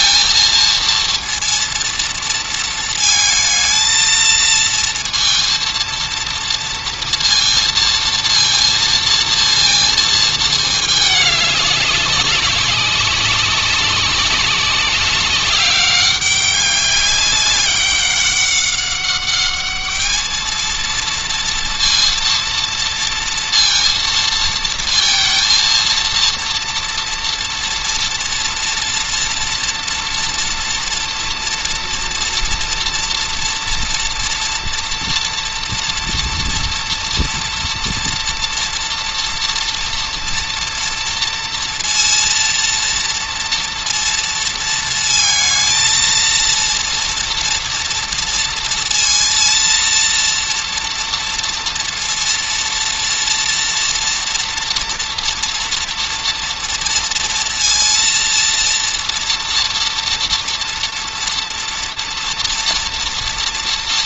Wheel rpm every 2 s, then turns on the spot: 230, 230, 230, 230, 230, 220, 200, 190, 200, 190, 220, 230, 230, 230, 230, 230, 230, 230, 230, 230, 230, 230, 220, 230, 230, 240, 230, 230, 230, 230, 230, 230.
none